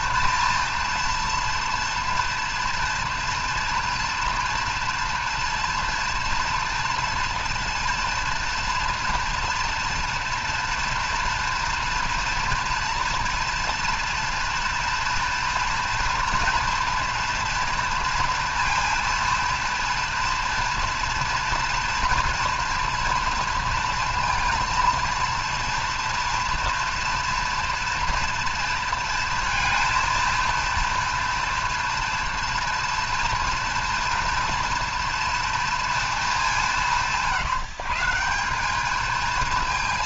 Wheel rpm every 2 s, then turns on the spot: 230, 230, 240, 230, 230, 230, 230, 230, 230, 230, 230, 240, 230, 230, 230, 230, 230, 230, 180, 210.
none